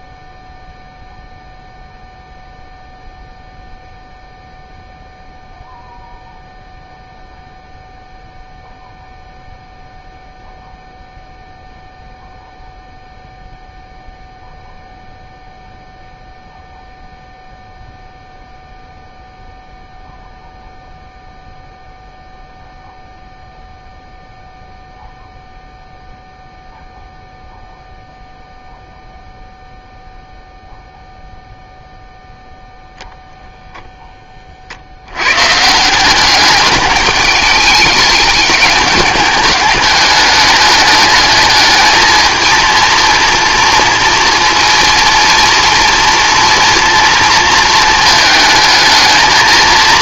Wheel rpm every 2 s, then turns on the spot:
0, 0, 0, 0, 0, 0, 0, 0, 0, 0, 0, 0, 0, 0, 0, 0, 0, 70, 210, 210, 210, 230, 230, 230, 220.
none